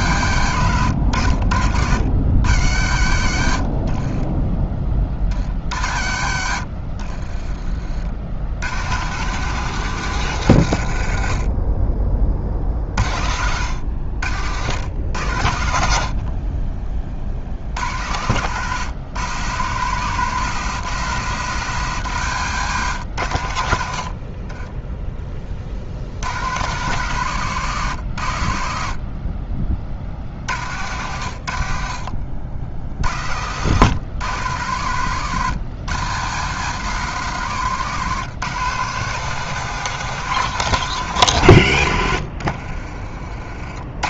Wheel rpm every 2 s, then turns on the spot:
100, 90, 30, 60, 100, 110, 40, 90, 30, 110, 140, 110, 20, 120, 60, 90, 70, 110, 130, 150, 150, 40.
4-6 12-16 24-26 42-44